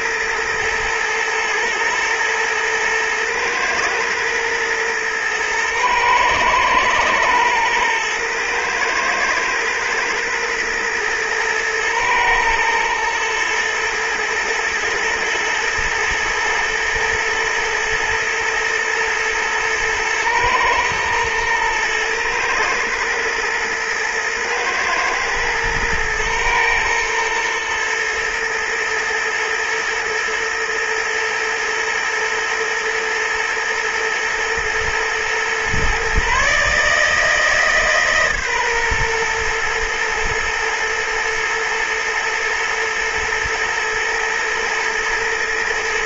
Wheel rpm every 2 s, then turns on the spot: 110, 120, 110, 110, 110, 110, 110, 110, 110, 110, 110, 120, 120, 110, 110, 120, 110, 120, 150, 130, 110, 120, 120.
none